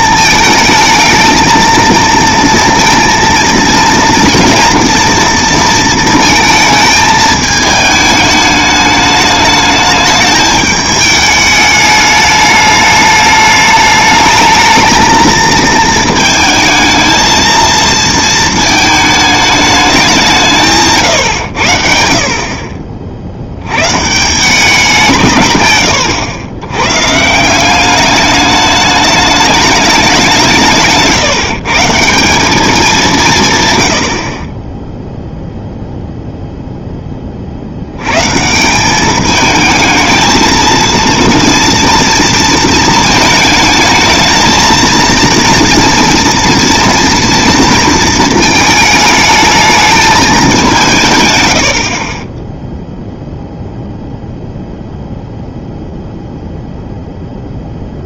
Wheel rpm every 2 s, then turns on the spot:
220, 230, 230, 220, 210, 210, 210, 220, 220, 220, 160, 50, 180, 100, 210, 170, 200, 30, 0, 160, 230, 230, 220, 240, 220, 200, 10, 0, 0.
none